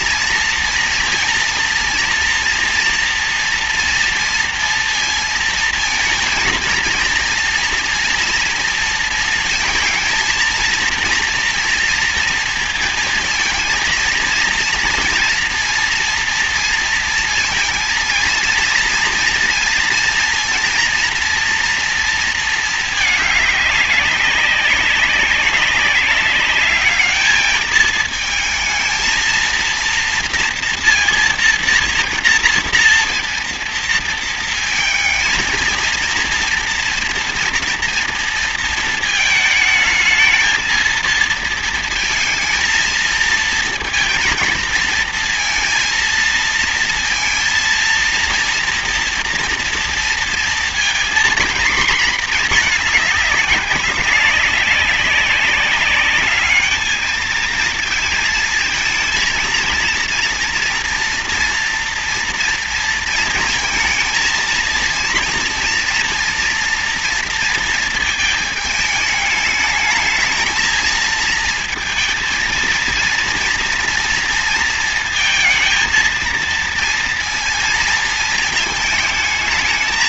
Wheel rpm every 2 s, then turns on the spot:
230, 230, 230, 230, 230, 230, 230, 230, 230, 230, 230, 210, 190, 210, 230, 230, 230, 230, 230, 220, 230, 230, 230, 230, 230, 230, 220, 200, 220, 230, 230, 230, 230, 230, 220, 230, 230, 230, 230, 220.
none